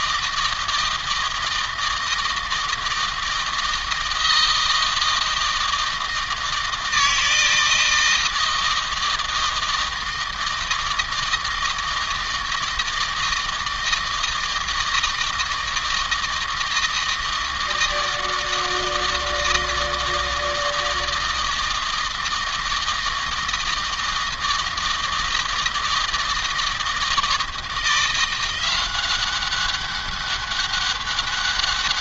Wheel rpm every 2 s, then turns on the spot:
160, 160, 160, 160, 160, 160, 160, 160, 160, 160, 160, 160, 160, 160, 180, 200.
none